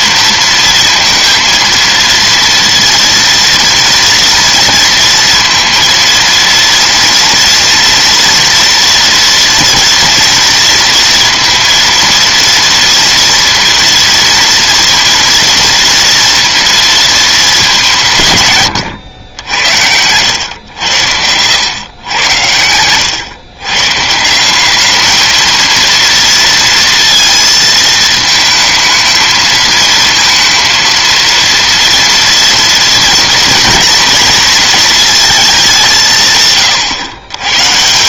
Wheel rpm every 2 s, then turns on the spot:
230, 230, 230, 230, 230, 230, 230, 230, 230, 130, 90, 100, 200, 230, 220, 230, 230, 220, 130.
none